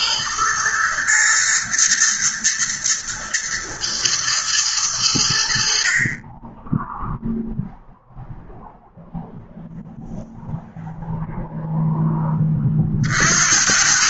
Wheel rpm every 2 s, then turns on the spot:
110, 110, 100, 0, 0, 0, 50.
none